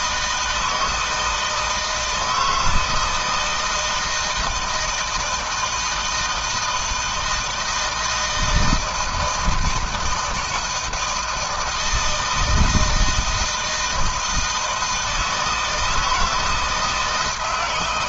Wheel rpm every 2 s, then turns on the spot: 160, 160, 160, 160, 160, 160, 160, 160, 170.
none